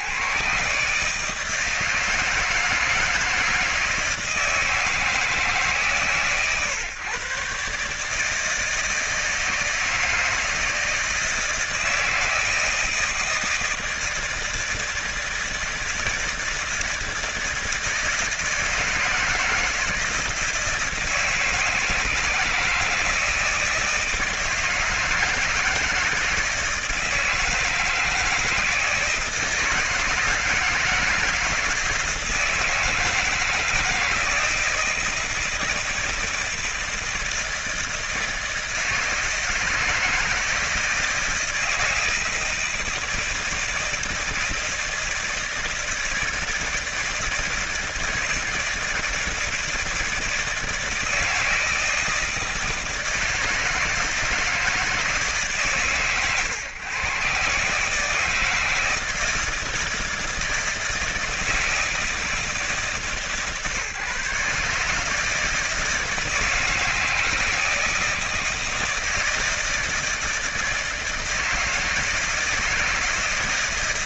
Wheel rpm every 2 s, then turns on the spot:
150, 160, 160, 120, 160, 160, 160, 160, 160, 160, 160, 160, 160, 160, 160, 160, 160, 170, 170, 160, 160, 160, 160, 160, 160, 160, 160, 160, 110, 160, 160, 160, 150, 160, 160, 160, 160.
none